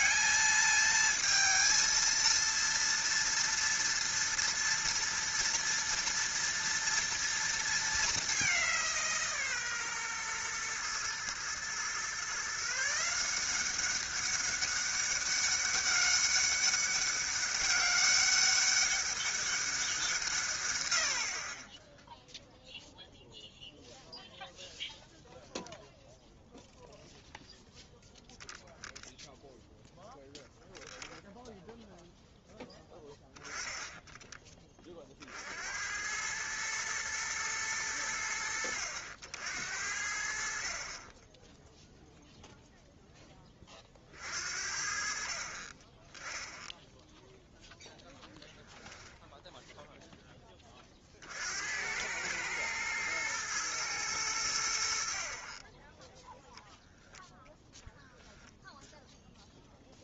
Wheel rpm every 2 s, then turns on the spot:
210, 230, 230, 230, 190, 120, 150, 200, 200, 200, 130, 0, 0, 0, 0, 0, 0, 20, 110, 70, 50, 0, 50, 10, 0, 20, 110, 80, 0, 0.
none